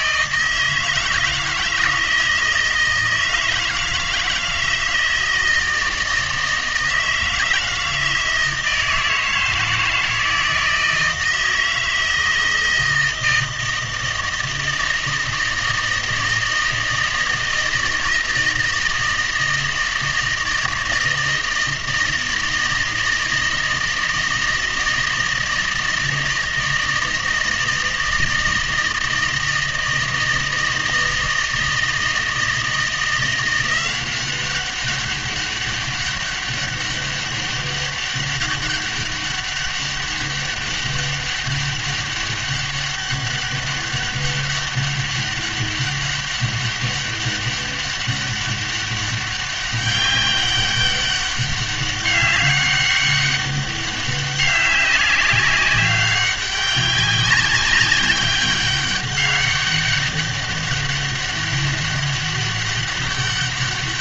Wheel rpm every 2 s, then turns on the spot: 160, 160, 160, 160, 160, 160, 160, 160, 160, 160, 160, 160, 160, 160, 160, 160, 170, 190, 200, 200, 200, 200, 200, 200, 200, 200, 200, 200, 200, 200, 200, 200.
none